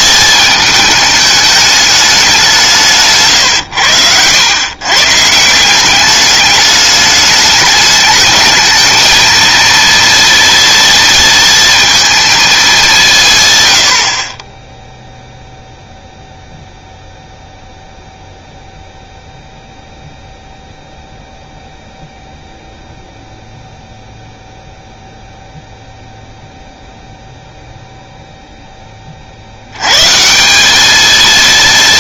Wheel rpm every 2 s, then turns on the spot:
220, 180, 110, 210, 220, 230, 220, 10, 0, 0, 0, 0, 0, 0, 10, 190.
none